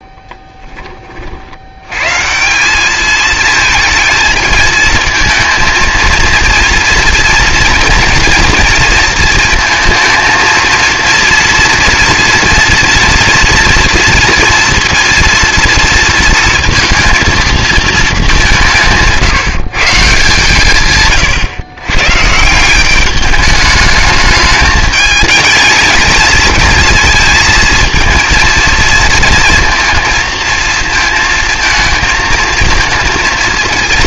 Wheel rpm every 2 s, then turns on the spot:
10, 190, 220, 230, 230, 230, 230, 230, 230, 180, 150, 170, 210, 230, 230, 220, 230.
none